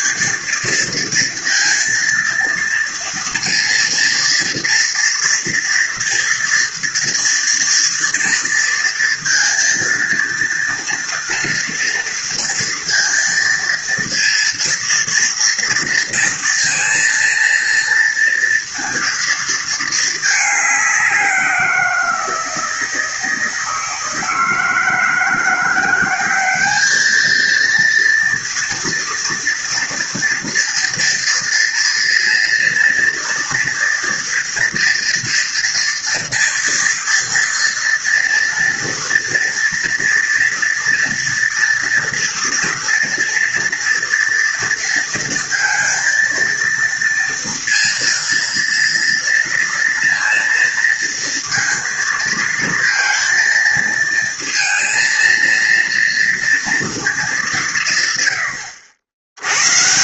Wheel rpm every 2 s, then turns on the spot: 230, 230, 230, 230, 230, 230, 230, 230, 230, 230, 190, 160, 160, 220, 240, 230, 230, 230, 230, 230, 240, 230, 230, 230, 230, 230, 230, 230, 210, 100.
none